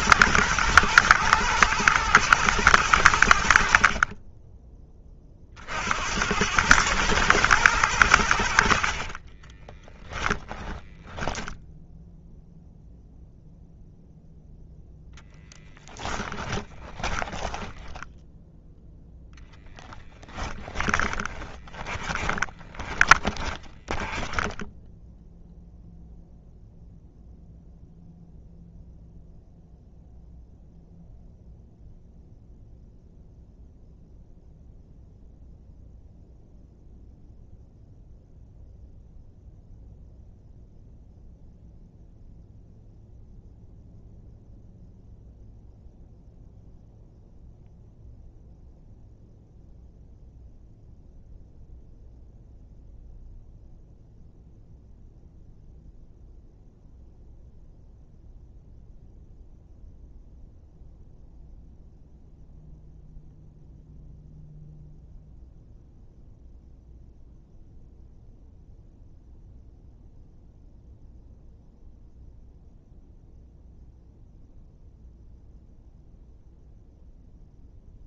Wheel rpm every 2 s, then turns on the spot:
110, 100, 30, 100, 80, 10, 0, 0, 20, 0, 20, 20, 20, 0, 0, 0, 0, 0, 0, 0, 0, 0, 0, 0, 0, 0, 0, 0, 0, 0, 0, 0, 0, 0, 0, 0, 0, 0, 0.
8-12 16-18 20-26